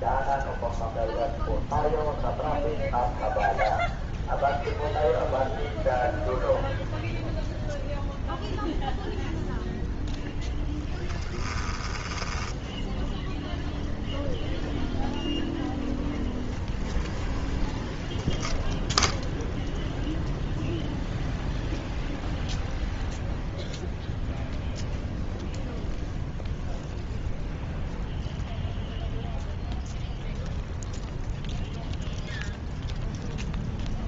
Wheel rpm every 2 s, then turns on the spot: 0, 0, 0, 0, 0, 10, 0, 0, 0, 0, 0, 0, 0, 0, 0, 0, 0.
10-12